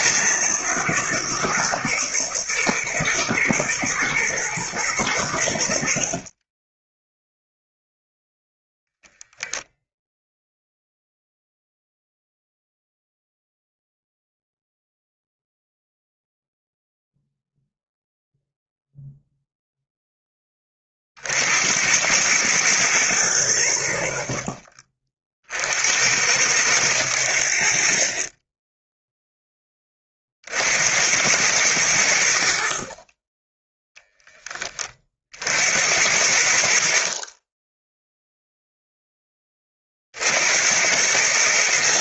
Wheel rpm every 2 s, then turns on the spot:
120, 120, 110, 10, 0, 0, 0, 0, 0, 0, 30, 110, 50, 90, 10, 70, 60, 30, 60, 0, 90.
none